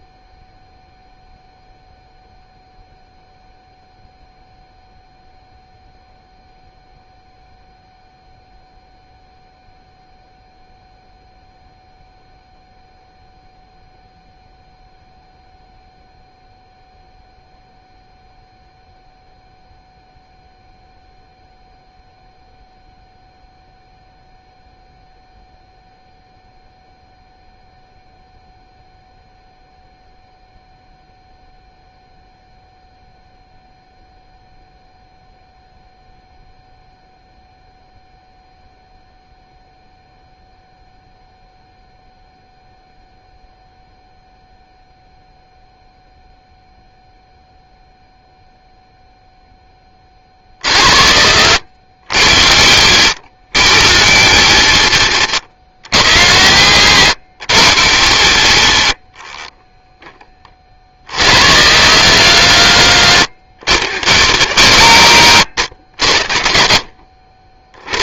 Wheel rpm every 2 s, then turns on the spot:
0, 0, 0, 0, 0, 0, 0, 0, 0, 0, 0, 0, 0, 0, 0, 0, 0, 0, 0, 0, 0, 0, 0, 0, 0, 60, 80, 120, 120, 80, 40, 130, 140, 70.
none